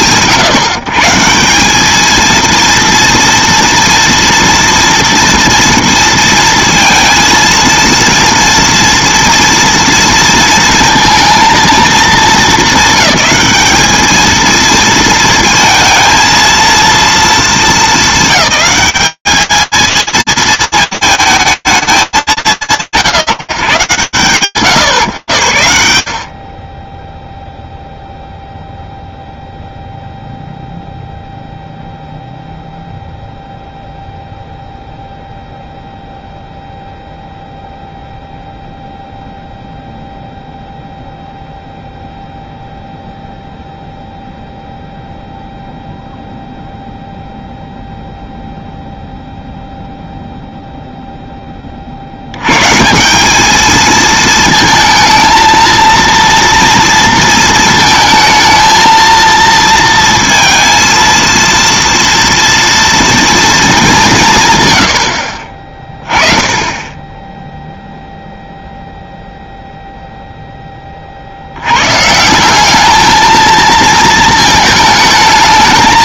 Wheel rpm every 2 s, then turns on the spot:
150, 230, 230, 230, 230, 230, 200, 230, 230, 210, 180, 150, 20, 0, 0, 0, 0, 0, 0, 0, 0, 0, 0, 0, 0, 10, 190, 230, 230, 230, 230, 230, 20, 10, 0, 30, 200, 220.
none